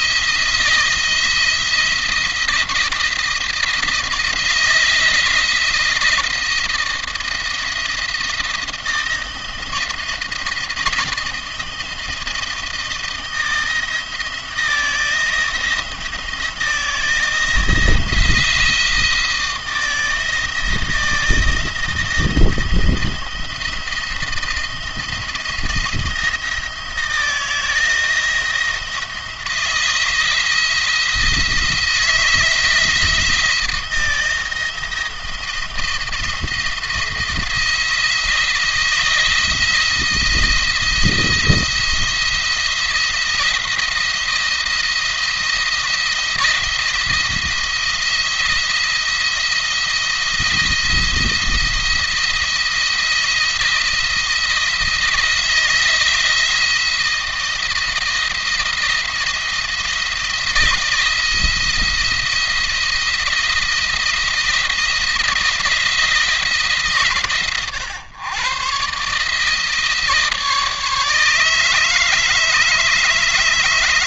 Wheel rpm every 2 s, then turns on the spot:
170, 170, 170, 170, 170, 160, 160, 170, 160, 170, 160, 160, 160, 160, 170, 170, 160, 170, 160, 170, 170, 170, 170, 170, 170, 170, 170, 170, 170, 170, 170, 170, 170, 150, 130, 160, 150.
none